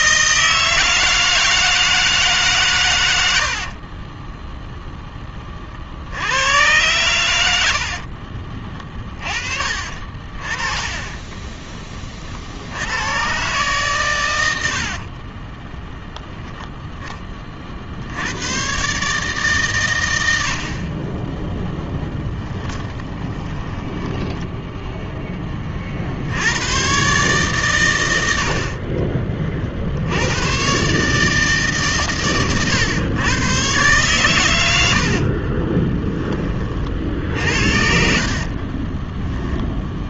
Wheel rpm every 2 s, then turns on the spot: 160, 90, 10, 100, 30, 30, 100, 40, 10, 140, 40, 20, 0, 120, 40, 140, 110, 70, 40, 10.
10-12 14-16 22-24 28-30 34-36 38-40